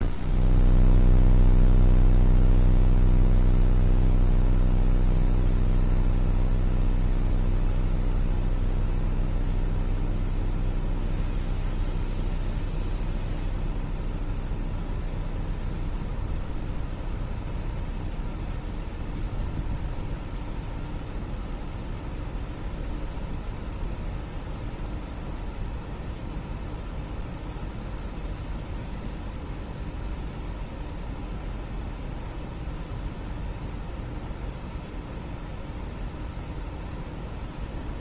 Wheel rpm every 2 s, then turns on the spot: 0, 0, 0, 0, 0, 0, 0, 0, 0, 0, 0, 0, 0, 0, 0, 0, 0, 0, 0.
none